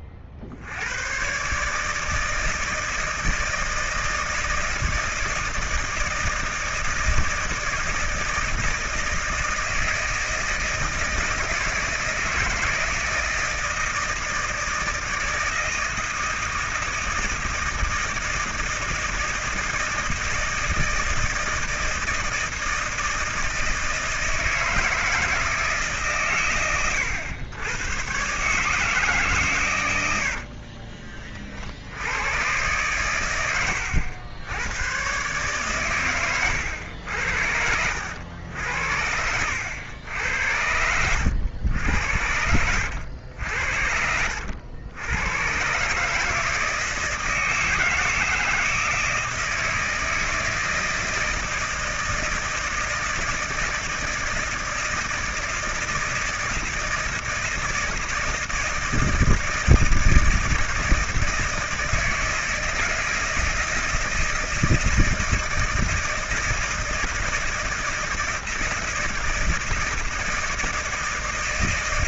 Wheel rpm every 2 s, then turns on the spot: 60, 160, 160, 160, 160, 160, 160, 160, 160, 160, 160, 160, 160, 110, 140, 60, 110, 100, 100, 80, 90, 80, 80, 160, 160, 160, 160, 160, 160, 160, 160, 160, 160, 160, 160, 160.
30-32 36-38 42-44